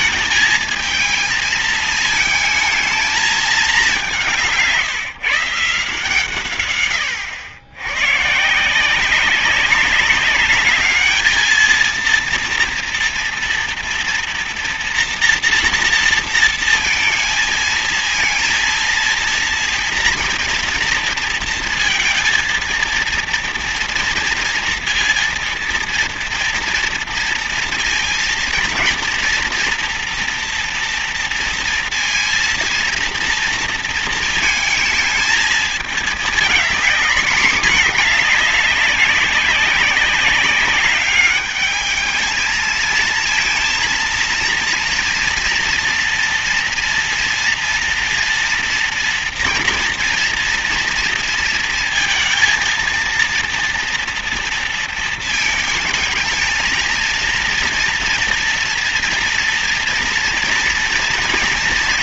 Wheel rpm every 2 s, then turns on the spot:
220, 220, 170, 120, 150, 210, 230, 230, 230, 230, 230, 230, 230, 230, 230, 230, 230, 230, 220, 200, 200, 220, 230, 230, 230, 230, 230, 230, 220, 240, 230.
none